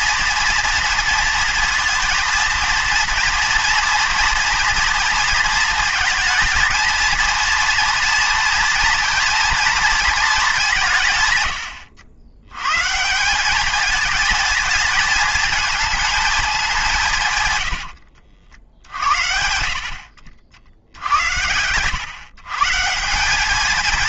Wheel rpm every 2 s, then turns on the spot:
230, 230, 230, 230, 230, 190, 120, 230, 200, 70, 70, 150.
18-20